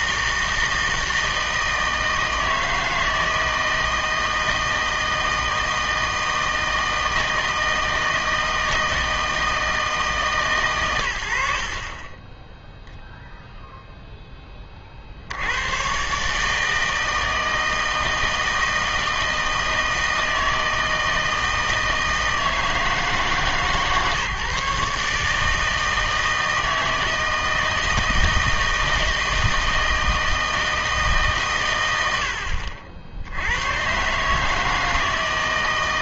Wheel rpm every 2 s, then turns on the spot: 160, 160, 160, 160, 160, 130, 10, 30, 150, 160, 160, 160, 150, 160, 160, 160, 50, 160.
none